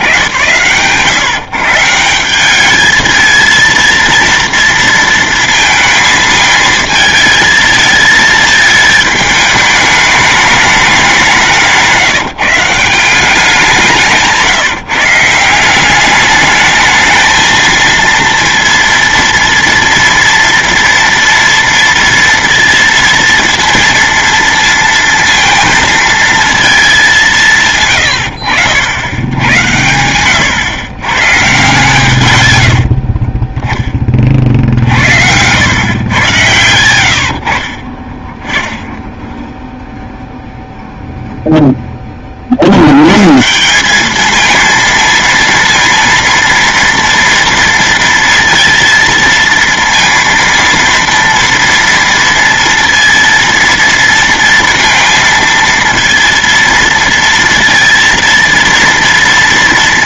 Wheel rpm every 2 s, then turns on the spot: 120, 210, 230, 220, 220, 210, 170, 160, 210, 230, 230, 230, 230, 220, 80, 120, 70, 50, 110, 10, 0, 70, 230, 230, 230, 230, 230, 230, 230, 230.
32-34